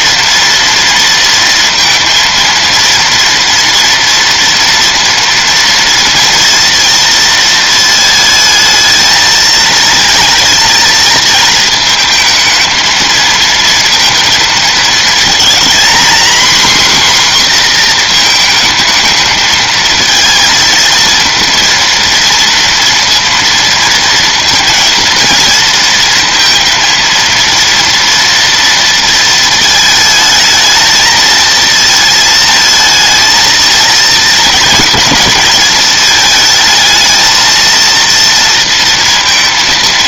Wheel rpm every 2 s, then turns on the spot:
230, 230, 240, 230, 220, 230, 220, 230, 250, 220, 230, 230, 230, 230, 230, 220, 220, 220, 220, 230.
none